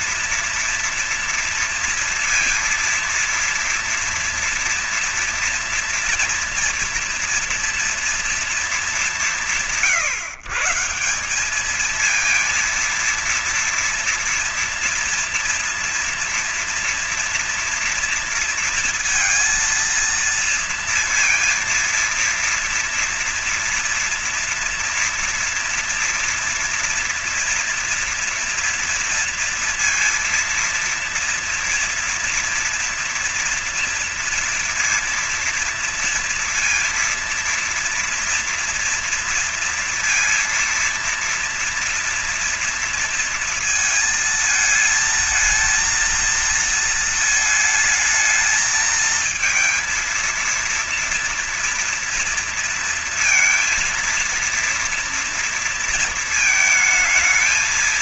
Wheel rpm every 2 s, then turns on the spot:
230, 230, 230, 230, 190, 140, 230, 230, 240, 230, 230, 230, 230, 230, 230, 230, 240, 230, 230, 230, 230, 230, 230, 230, 220, 230, 230, 230, 220.
none